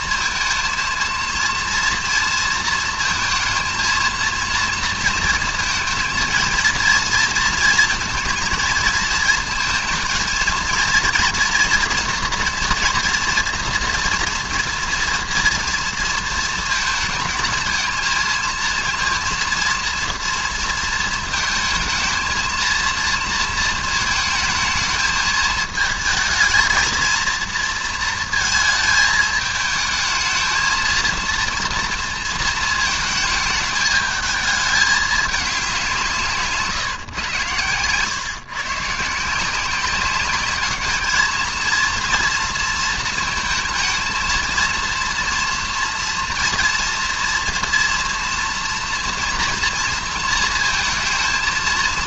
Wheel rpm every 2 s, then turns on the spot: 230, 230, 230, 230, 220, 230, 230, 240, 230, 230, 230, 230, 220, 220, 220, 220, 230, 220, 150, 140, 210, 230, 220, 230, 230, 220.
none